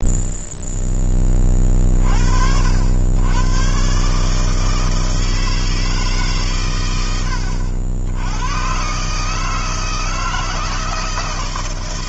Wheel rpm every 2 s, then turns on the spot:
0, 80, 160, 120, 110, 160.
none